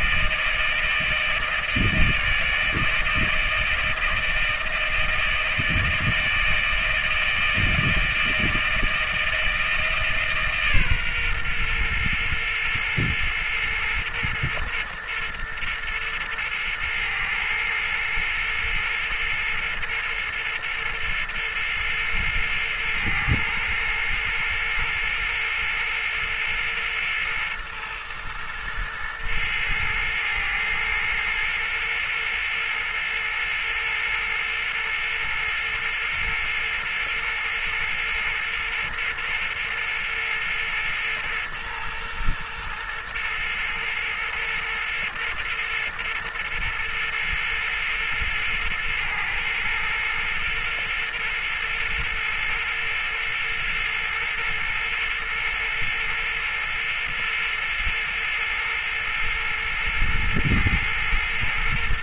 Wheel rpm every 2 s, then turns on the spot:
160, 160, 160, 160, 160, 150, 120, 120, 120, 120, 120, 120, 120, 120, 120, 120, 120, 120, 120, 120, 120, 120, 120, 120, 120, 120, 120, 120, 120, 120, 120.
none